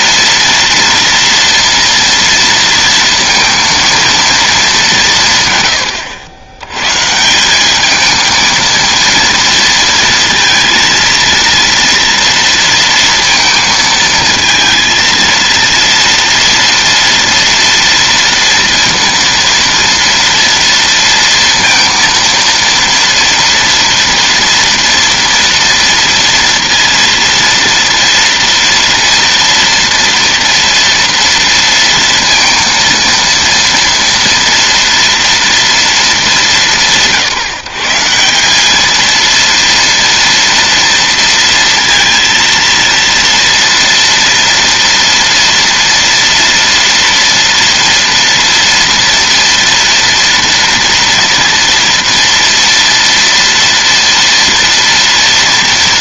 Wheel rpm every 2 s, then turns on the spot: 230, 240, 230, 110, 220, 230, 230, 220, 230, 230, 230, 230, 230, 230, 230, 230, 230, 230, 220, 170, 230, 230, 230, 230, 230, 230, 230, 230.
none